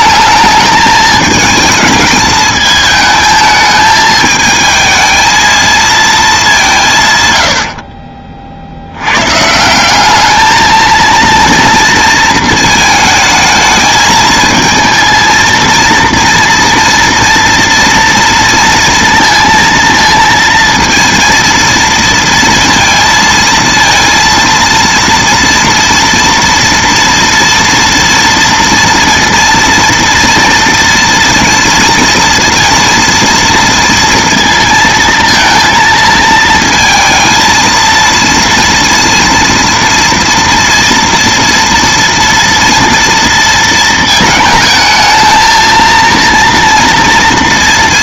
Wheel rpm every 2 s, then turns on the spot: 210, 210, 220, 190, 70, 220, 220, 220, 230, 230, 230, 230, 230, 230, 230, 230, 230, 230, 220, 230, 230, 230, 220, 230.
none